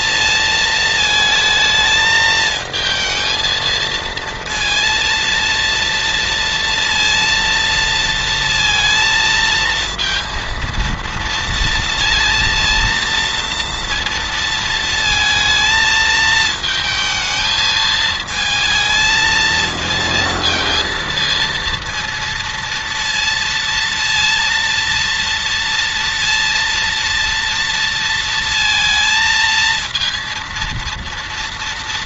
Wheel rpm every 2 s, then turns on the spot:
220, 220, 230, 230, 230, 230, 230, 230, 220, 220, 230, 230, 230, 230, 220, 230.
none